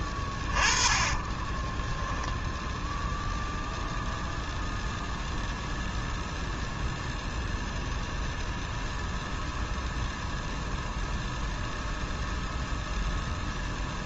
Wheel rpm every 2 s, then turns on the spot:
30, 0, 0, 0, 0, 0, 0.
0-2